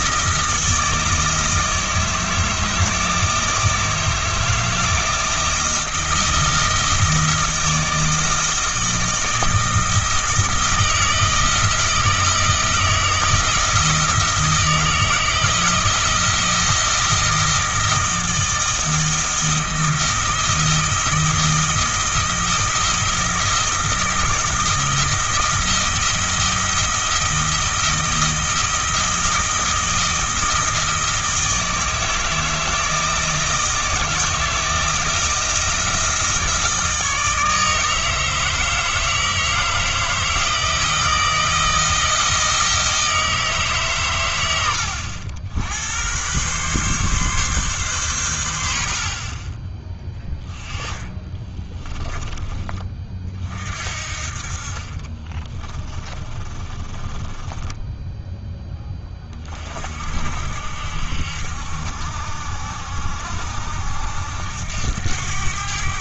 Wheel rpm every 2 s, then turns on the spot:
160, 160, 160, 160, 160, 160, 160, 160, 160, 160, 160, 160, 170, 160, 160, 160, 160, 160, 160, 160, 160, 160, 90, 130, 70, 20, 20, 40, 30, 10, 60, 70, 80.
50-52 54-58